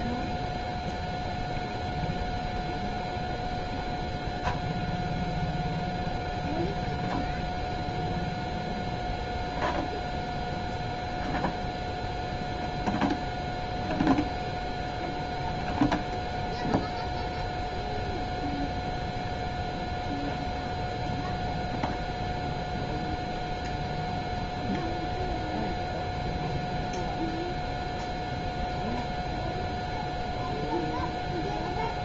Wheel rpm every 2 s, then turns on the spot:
0, 0, 0, 0, 0, 0, 0, 0, 0, 0, 0, 0, 0, 0, 0, 0.
none